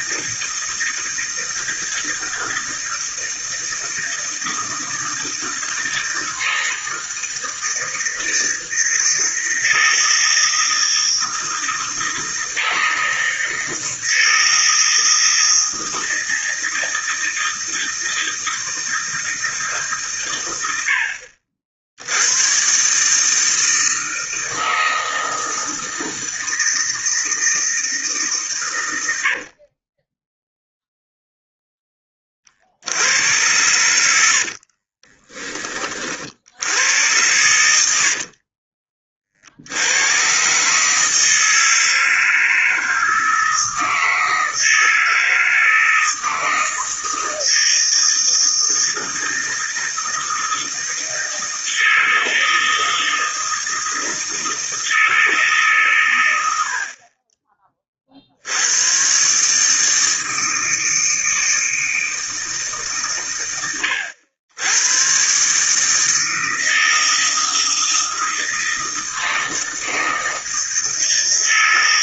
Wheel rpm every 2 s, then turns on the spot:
160, 160, 160, 160, 160, 160, 160, 160, 160, 160, 80, 130, 160, 160, 100, 0, 70, 50, 90, 40, 140, 160, 160, 160, 160, 160, 160, 160, 50, 100, 160, 140, 110, 160, 160, 160.
34-36 38-40